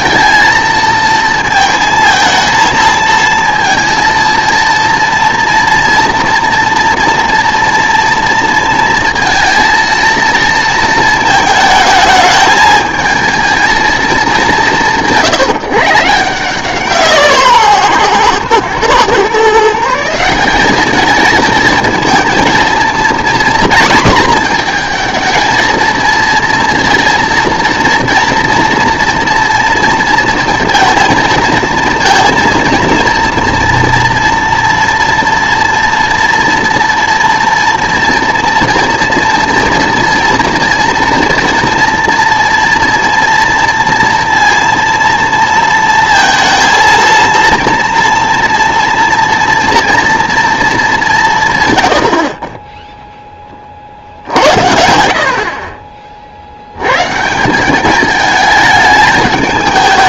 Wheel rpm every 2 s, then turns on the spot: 230, 220, 230, 230, 230, 220, 220, 190, 170, 120, 200, 230, 230, 230, 230, 230, 230, 230, 230, 230, 240, 230, 230, 220, 230, 220, 20, 80, 100, 220.
none